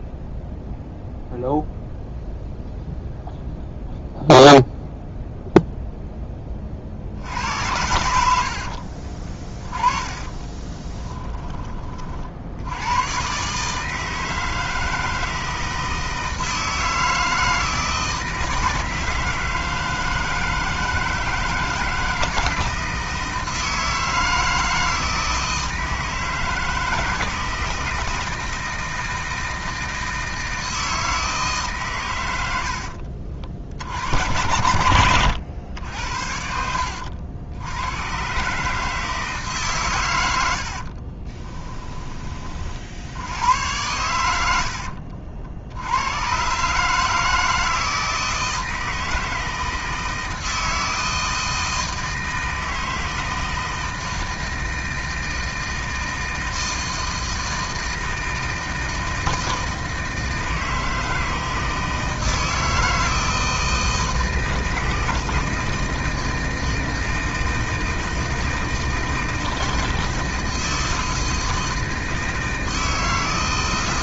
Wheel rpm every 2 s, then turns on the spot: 0, 0, 0, 40, 60, 20, 80, 160, 160, 160, 160, 160, 160, 170, 160, 160, 50, 90, 70, 150, 60, 60, 70, 140, 160, 160, 160, 160, 160, 160, 160, 160, 160, 160, 160, 160, 160.
8-12 32-34 40-42